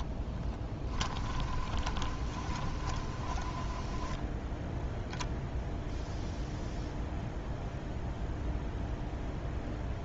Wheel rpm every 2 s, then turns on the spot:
20, 30, 0, 0, 0.
0-4